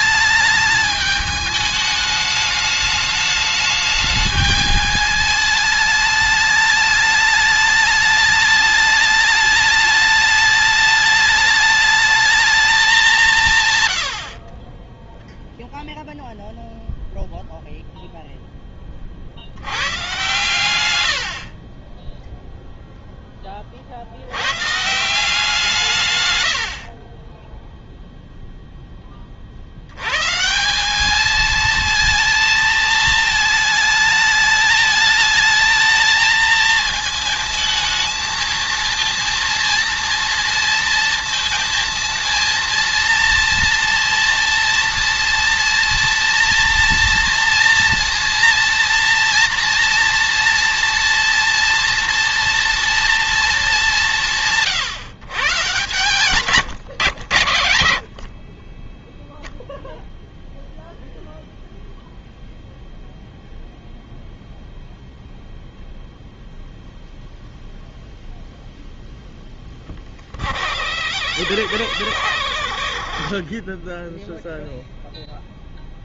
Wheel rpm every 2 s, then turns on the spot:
210, 210, 210, 210, 210, 210, 160, 0, 0, 20, 90, 0, 140, 80, 10, 170, 220, 210, 220, 220, 230, 230, 230, 240, 230, 230, 230, 150, 130, 30, 0, 0, 0, 0, 0, 40, 70, 0.
none